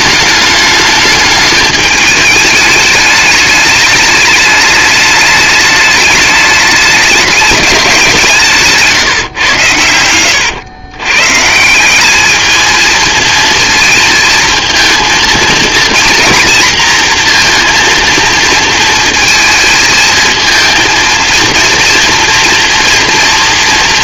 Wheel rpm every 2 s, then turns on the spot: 210, 210, 220, 210, 140, 120, 230, 230, 230, 230, 230, 230.
none